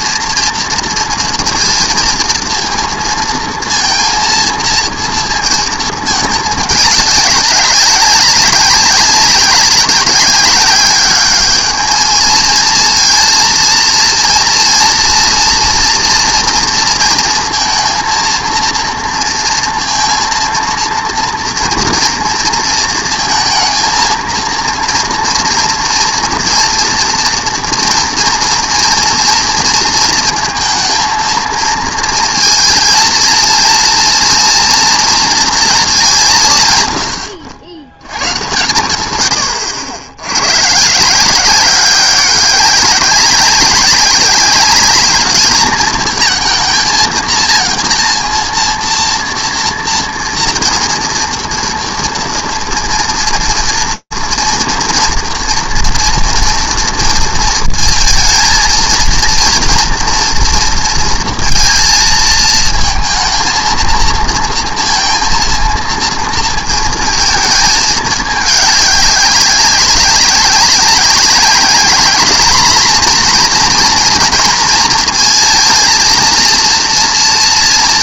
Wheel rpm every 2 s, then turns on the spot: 230, 230, 230, 200, 190, 190, 220, 230, 230, 230, 230, 230, 230, 230, 230, 230, 230, 230, 150, 120, 110, 200, 200, 230, 230, 230, 230, 230, 230, 230, 230, 220, 230, 230, 210, 200, 230, 230, 230.
none